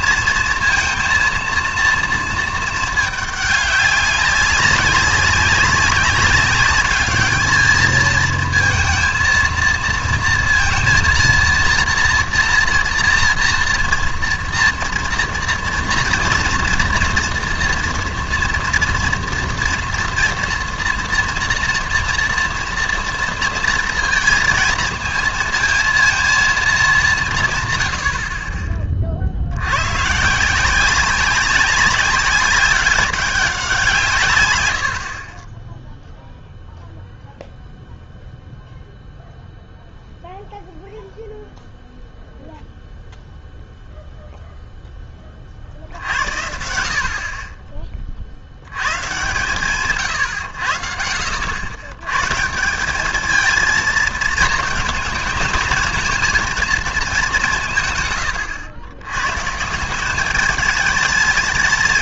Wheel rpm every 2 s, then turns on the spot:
230, 220, 200, 200, 230, 230, 230, 230, 230, 230, 240, 230, 220, 220, 30, 170, 190, 110, 0, 0, 0, 0, 0, 80, 90, 80, 170, 220, 220, 100, 210.
none